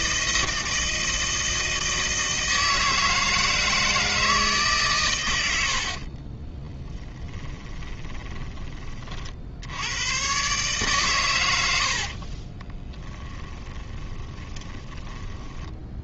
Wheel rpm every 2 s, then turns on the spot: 160, 160, 160, 30, 30, 130, 10, 20.
6-8 12-14